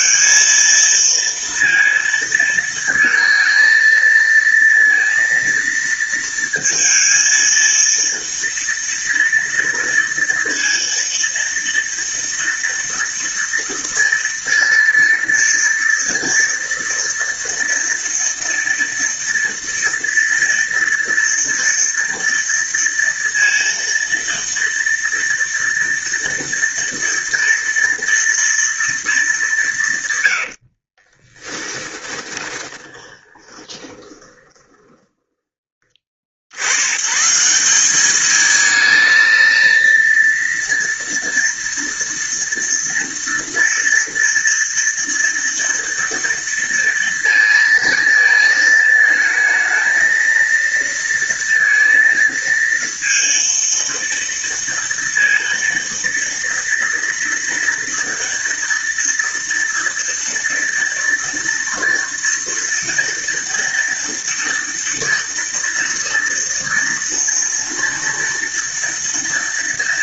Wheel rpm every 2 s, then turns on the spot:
230, 230, 230, 230, 230, 230, 230, 230, 230, 230, 230, 230, 230, 230, 230, 70, 20, 20, 90, 220, 230, 230, 230, 230, 220, 230, 230, 230, 230, 230, 230, 230, 230, 230, 230.
30-36